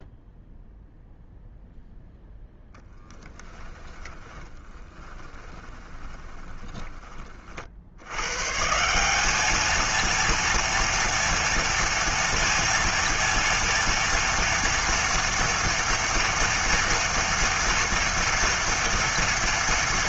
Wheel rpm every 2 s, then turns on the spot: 0, 0, 10, 20, 140, 230, 230, 230, 230, 230.
4-8